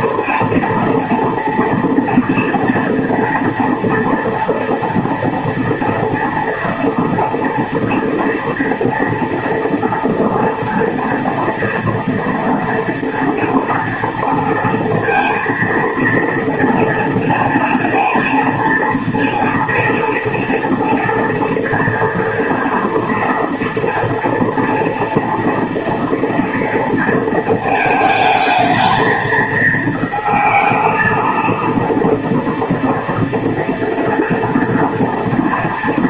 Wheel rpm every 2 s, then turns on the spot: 230, 230, 230, 230, 230, 230, 230, 230, 230, 230, 230, 230, 240, 230, 220, 220, 230, 230.
none